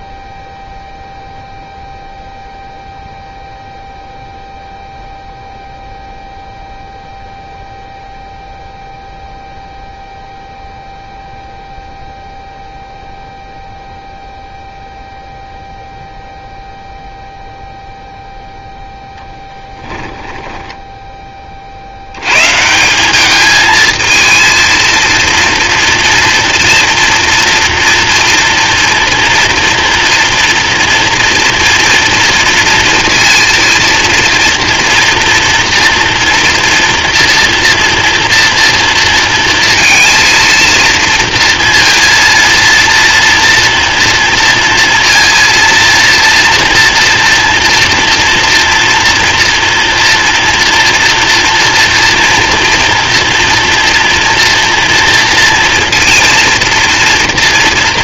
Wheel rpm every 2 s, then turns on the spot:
0, 0, 0, 0, 0, 0, 0, 0, 0, 0, 10, 150, 230, 230, 230, 230, 230, 230, 230, 240, 230, 230, 230, 230, 230, 230, 230, 230, 230.
none